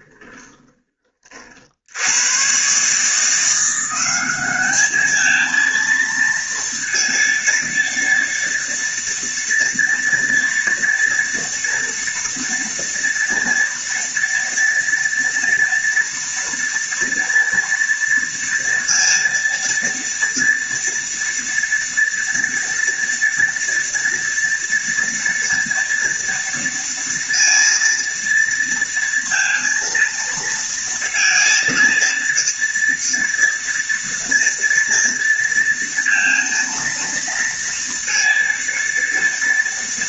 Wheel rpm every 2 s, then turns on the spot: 20, 110, 200, 230, 230, 230, 240, 230, 230, 230, 230, 230, 230, 230, 230, 230, 230, 230, 230, 230.
0-2